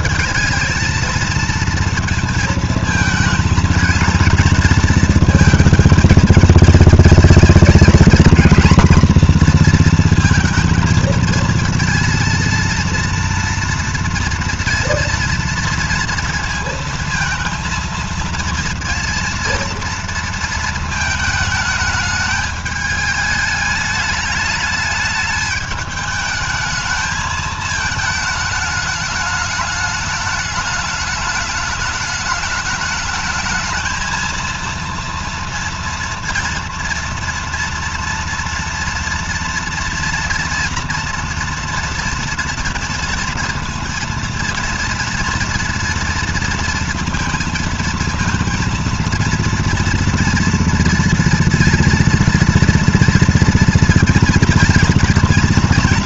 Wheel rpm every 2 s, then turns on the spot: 220, 230, 230, 220, 230, 230, 230, 230, 230, 230, 220, 210, 210, 220, 210, 210, 210, 230, 230, 230, 230, 230, 230, 230, 230, 230, 230, 230.
none